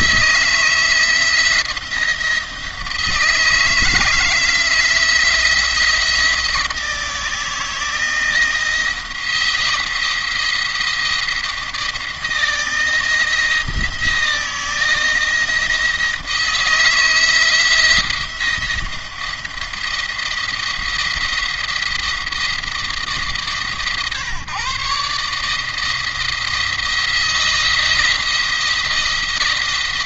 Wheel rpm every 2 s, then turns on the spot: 160, 170, 160, 160, 170, 170, 160, 170, 160, 170, 170, 160, 140, 160, 170.
none